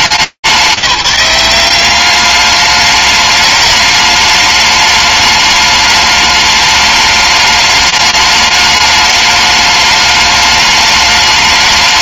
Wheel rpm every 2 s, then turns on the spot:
190, 200, 210, 210, 210, 210.
none